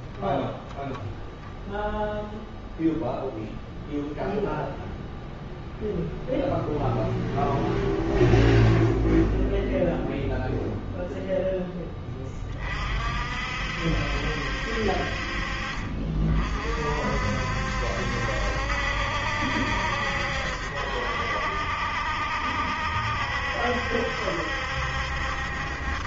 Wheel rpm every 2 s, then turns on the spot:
0, 0, 0, 0, 0, 0, 60, 50, 60, 70, 70, 70, 70.
none